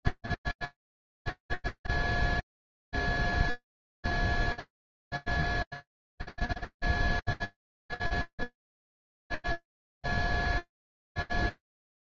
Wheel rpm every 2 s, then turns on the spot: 10, 0, 0, 0, 0, 0.
0-2